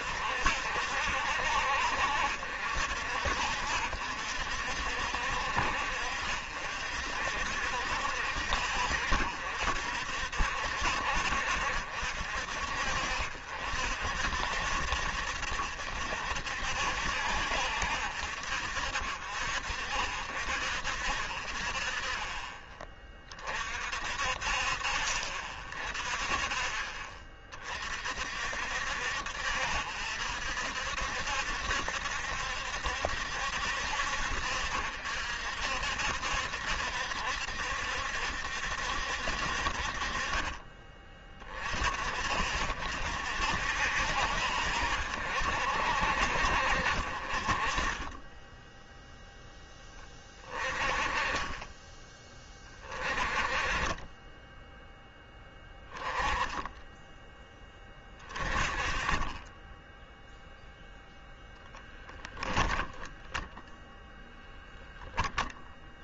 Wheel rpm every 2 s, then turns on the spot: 60, 60, 60, 60, 60, 60, 60, 60, 60, 60, 50, 30, 40, 30, 60, 60, 70, 60, 70, 60, 30, 60, 60, 60, 10, 20, 30, 10, 10, 30, 0, 20, 10.
62-64